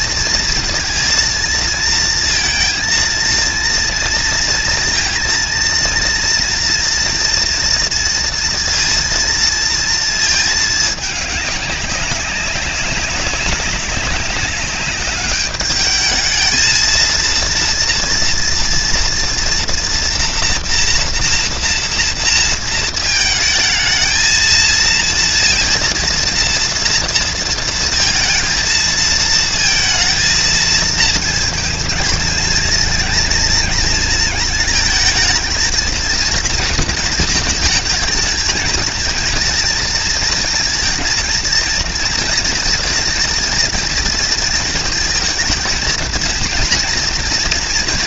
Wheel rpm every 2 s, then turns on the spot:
230, 230, 230, 240, 230, 210, 190, 200, 230, 230, 240, 220, 230, 230, 220, 220, 230, 220, 230, 230, 230, 230, 230, 230.
none